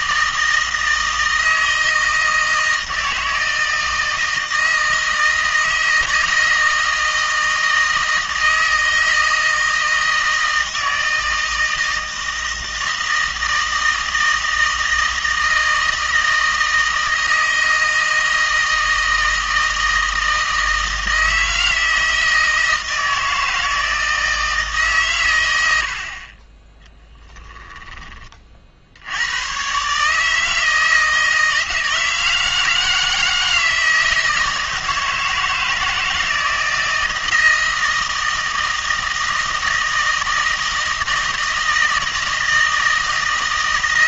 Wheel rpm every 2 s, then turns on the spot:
160, 160, 160, 160, 160, 160, 160, 160, 160, 160, 160, 160, 150, 20, 60, 160, 160, 160, 160, 160, 160, 160.
none